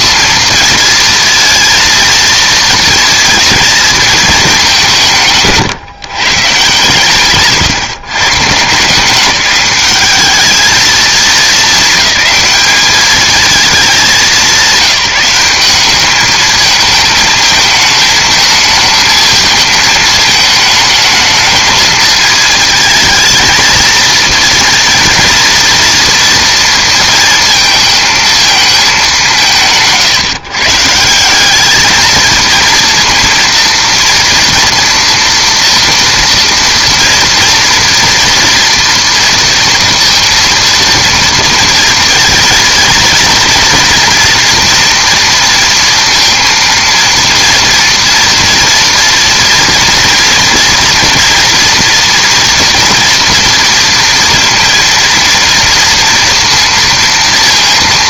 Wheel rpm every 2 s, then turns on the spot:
230, 220, 180, 150, 170, 220, 210, 190, 220, 220, 220, 220, 230, 230, 210, 160, 230, 240, 230, 240, 230, 220, 230, 230, 230, 230, 230, 230, 230.
none